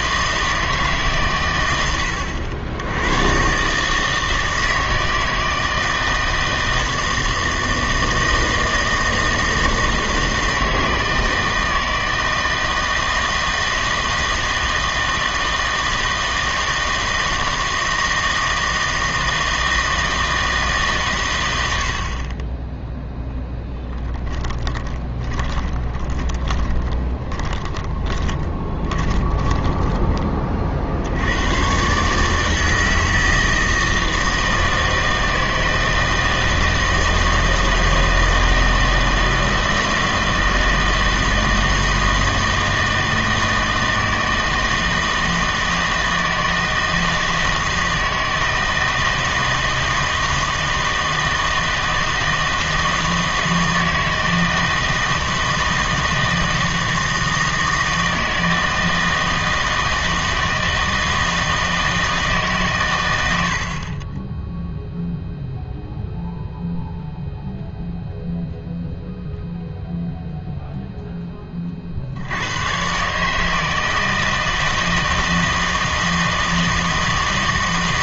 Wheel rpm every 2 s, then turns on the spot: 160, 90, 160, 160, 160, 160, 160, 160, 160, 160, 160, 0, 20, 20, 20, 40, 160, 160, 160, 160, 160, 160, 160, 160, 160, 160, 160, 160, 160, 160, 160, 130, 0, 0, 0, 0, 110, 160, 160.
24-30